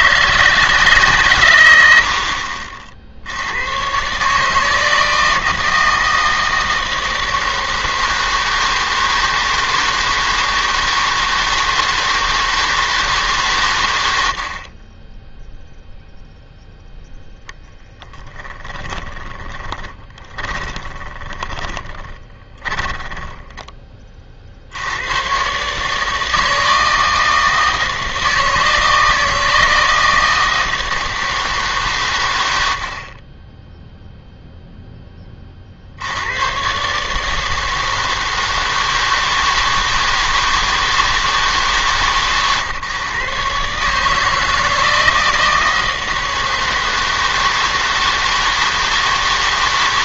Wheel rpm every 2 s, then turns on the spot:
150, 40, 150, 160, 160, 160, 160, 60, 0, 20, 20, 10, 60, 160, 160, 160, 100, 0, 110, 160, 160, 130, 160, 160, 160.
18-24